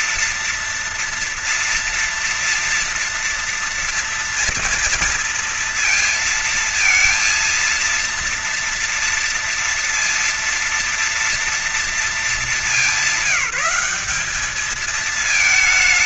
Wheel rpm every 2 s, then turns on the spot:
240, 240, 230, 230, 230, 230, 220, 210.
none